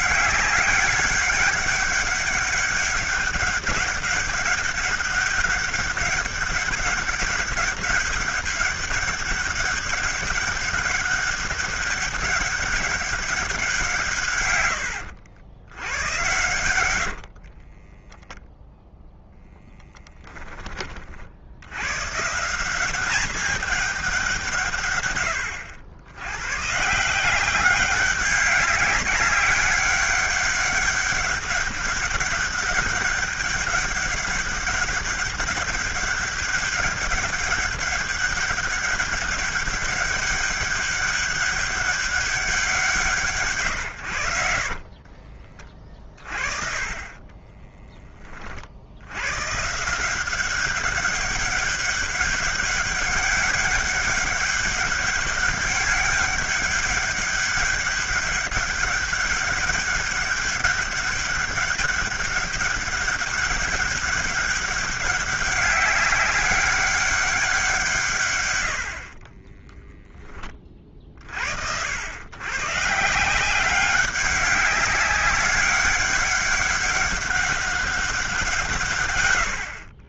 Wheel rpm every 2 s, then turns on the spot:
200, 200, 200, 200, 200, 200, 200, 100, 90, 0, 20, 180, 140, 120, 200, 200, 200, 200, 200, 200, 200, 180, 70, 30, 50, 190, 200, 200, 200, 200, 200, 200, 200, 200, 80, 40, 140, 200, 200, 160.
44-46